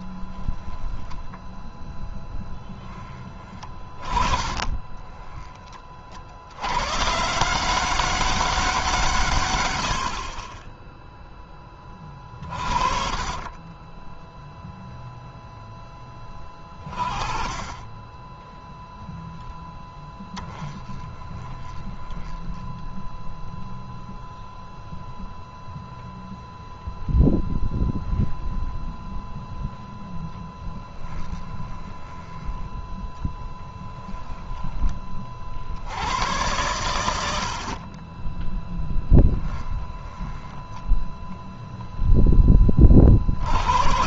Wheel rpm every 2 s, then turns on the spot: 10, 20, 30, 130, 140, 10, 30, 10, 30, 0, 20, 10, 0, 0, 0, 10, 10, 30, 90, 10, 10, 50.
0-2 4-6 12-14 20-24 30-34 38-42